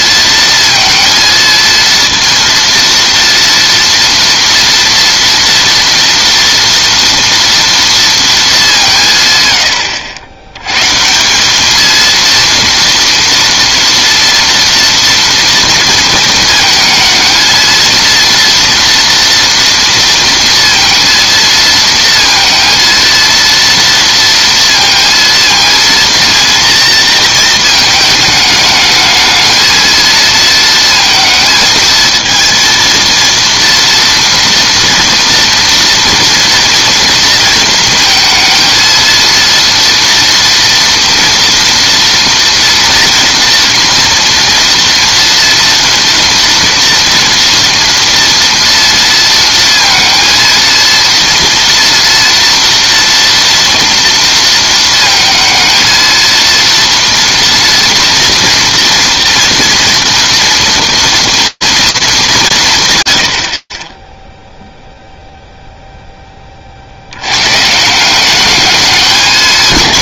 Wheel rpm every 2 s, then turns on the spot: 230, 230, 230, 230, 200, 100, 230, 230, 220, 230, 230, 230, 230, 230, 210, 230, 230, 230, 240, 230, 230, 230, 240, 230, 230, 230, 230, 230, 230, 230, 230, 160, 0, 40, 210.
none